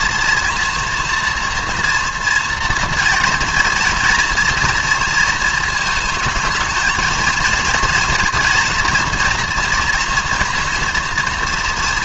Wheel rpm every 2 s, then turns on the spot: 230, 230, 230, 220, 240, 230.
none